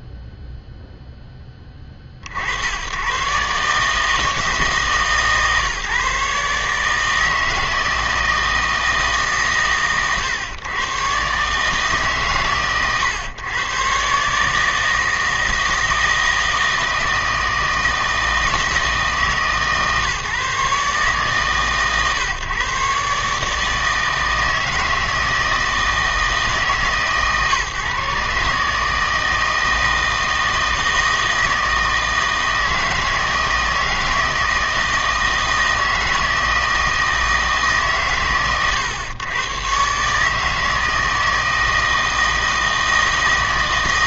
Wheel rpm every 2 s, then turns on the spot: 0, 100, 150, 150, 150, 120, 110, 160, 160, 160, 140, 130, 160, 140, 160, 160, 160, 160, 160, 120, 160, 160.
none